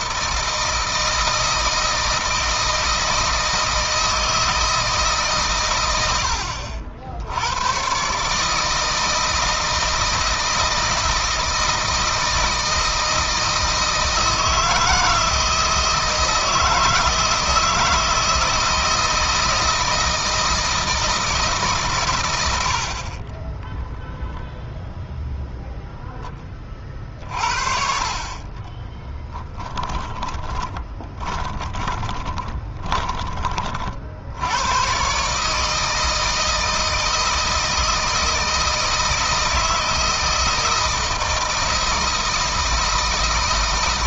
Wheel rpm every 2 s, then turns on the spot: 160, 160, 160, 70, 160, 160, 160, 160, 160, 160, 160, 60, 0, 30, 10, 20, 20, 110, 160, 160, 160, 160.
22-24 28-34